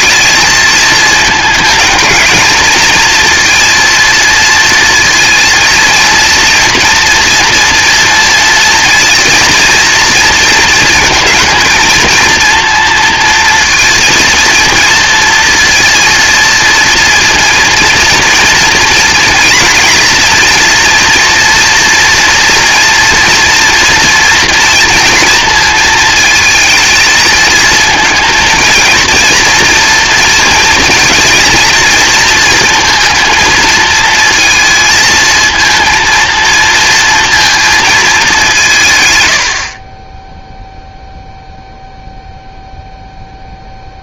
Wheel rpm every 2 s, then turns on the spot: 220, 230, 230, 230, 230, 220, 230, 230, 230, 240, 230, 230, 230, 220, 230, 230, 230, 230, 230, 90, 0, 0.
none